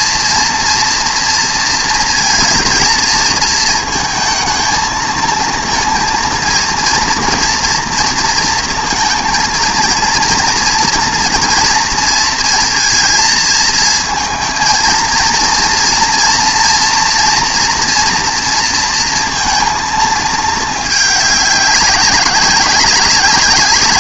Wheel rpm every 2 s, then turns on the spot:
230, 230, 220, 230, 230, 240, 230, 230, 230, 230, 220, 190.
none